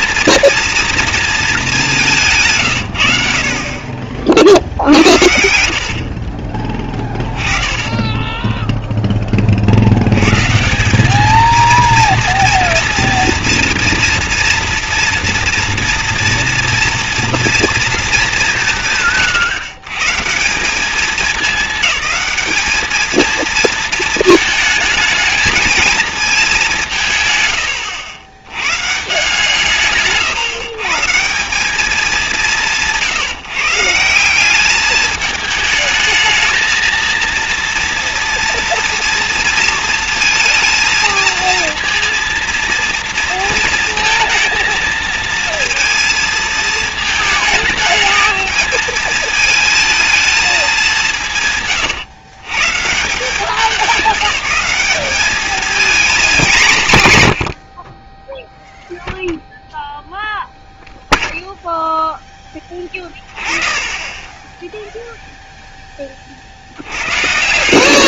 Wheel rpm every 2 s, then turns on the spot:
240, 120, 60, 30, 10, 180, 230, 230, 230, 170, 190, 210, 220, 180, 120, 140, 170, 200, 220, 230, 230, 230, 230, 220, 220, 190, 140, 190, 190, 0, 0, 10, 10, 80.
6-8